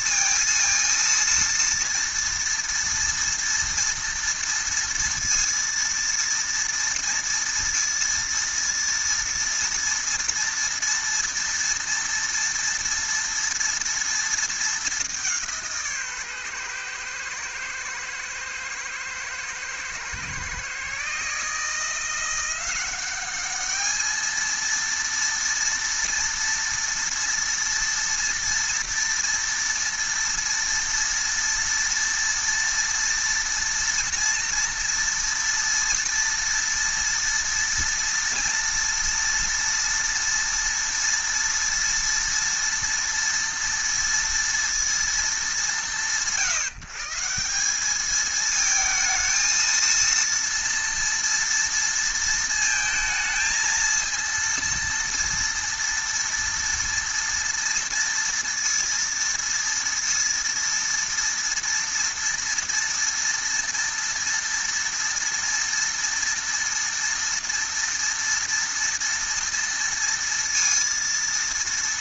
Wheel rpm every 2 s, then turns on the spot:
230, 230, 230, 230, 230, 230, 230, 220, 130, 110, 130, 180, 230, 230, 230, 230, 230, 230, 230, 230, 230, 230, 230, 150, 220, 230, 230, 230, 230, 230, 230, 230, 230, 230, 230, 230.
none